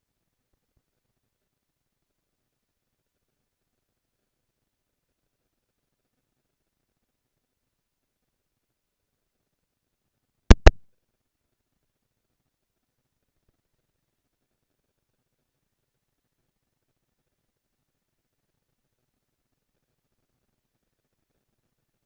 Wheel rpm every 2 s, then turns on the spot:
230, 230, 230, 230, 230, 220, 200, 190, 230, 240, 230.
none